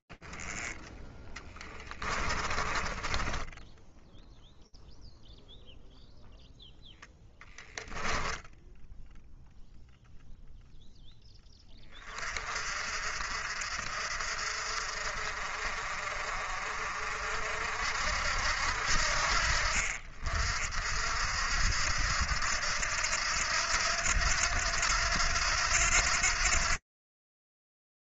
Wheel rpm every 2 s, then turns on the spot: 20, 10, 0, 10, 0, 40, 50, 50, 70, 50, 80, 90, 90, 70.
0-2 6-8